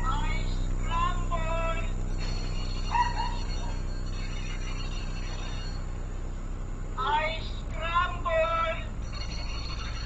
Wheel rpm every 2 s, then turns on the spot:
0, 0, 0, 0, 0.
none